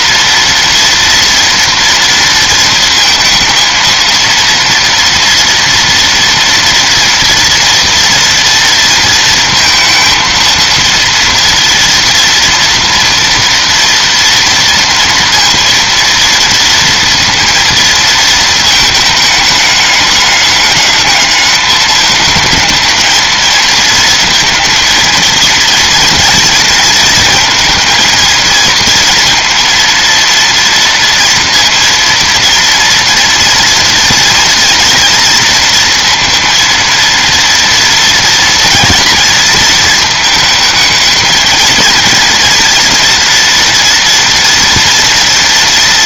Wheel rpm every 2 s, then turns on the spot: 230, 230, 230, 230, 230, 230, 230, 230, 230, 220, 210, 220, 230, 230, 230, 230, 230, 240, 230, 230, 220, 230, 230.
none